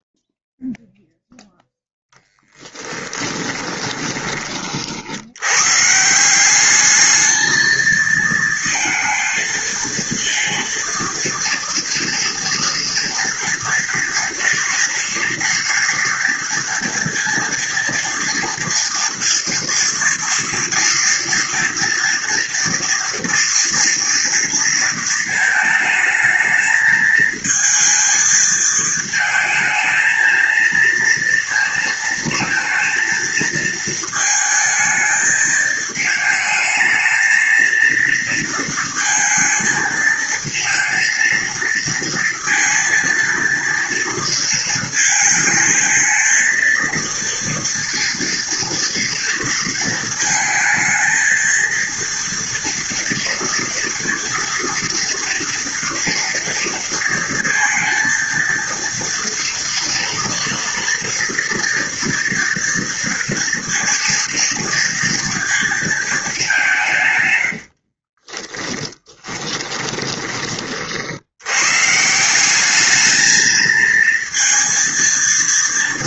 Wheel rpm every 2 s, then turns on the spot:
0, 10, 30, 190, 220, 230, 230, 230, 230, 230, 230, 240, 230, 220, 220, 230, 220, 220, 220, 230, 230, 230, 220, 230, 230, 220, 230, 230, 230, 230, 230, 230, 230, 180, 10, 30, 200, 230.
2-4 68-70